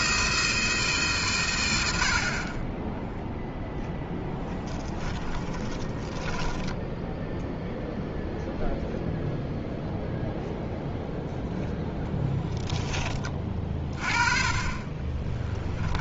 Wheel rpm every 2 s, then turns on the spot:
160, 20, 10, 10, 0, 0, 10, 20.
4-6